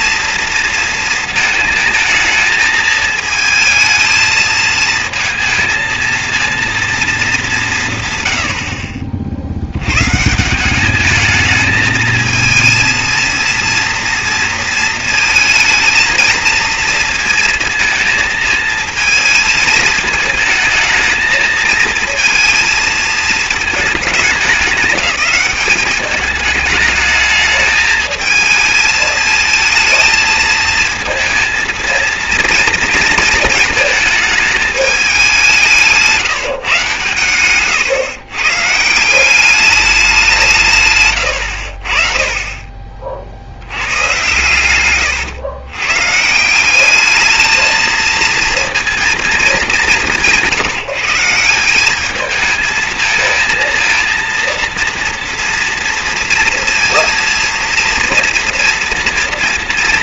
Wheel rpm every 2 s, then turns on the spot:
230, 220, 230, 210, 70, 210, 230, 230, 230, 220, 220, 230, 200, 210, 220, 230, 230, 190, 130, 180, 100, 70, 110, 210, 220, 170, 230, 230, 230, 230.
40-42